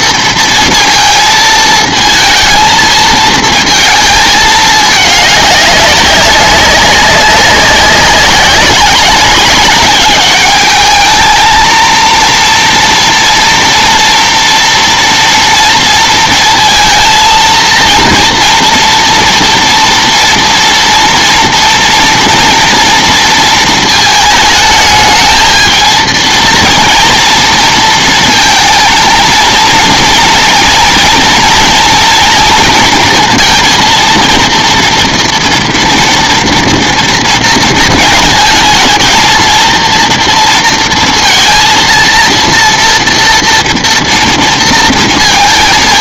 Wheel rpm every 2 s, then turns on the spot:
230, 220, 210, 200, 190, 210, 240, 240, 230, 230, 230, 240, 220, 230, 230, 230, 230, 230, 240, 220, 230, 230, 230.
none